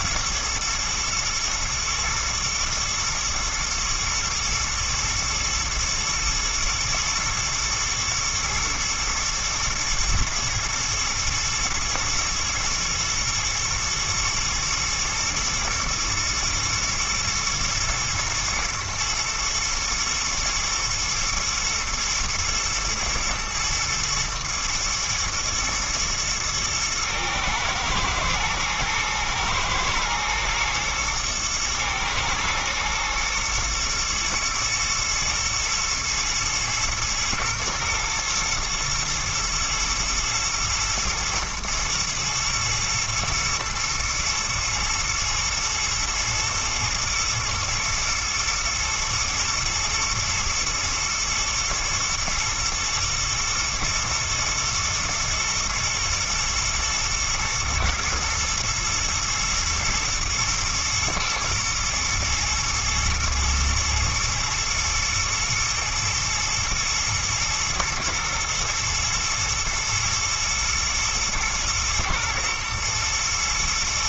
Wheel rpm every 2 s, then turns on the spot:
120, 120, 110, 110, 110, 120, 120, 110, 120, 120, 110, 120, 110, 120, 110, 110, 110, 110, 120, 110, 110, 120, 110, 120, 110, 120, 120, 120, 110, 110, 110, 120, 120, 120, 120, 120, 110.
none